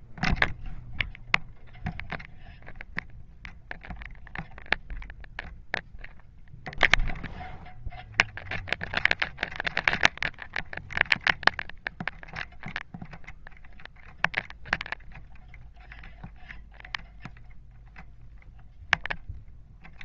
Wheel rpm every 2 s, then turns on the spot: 0, 0, 0, 0, 0, 0, 0, 0, 0, 0.
none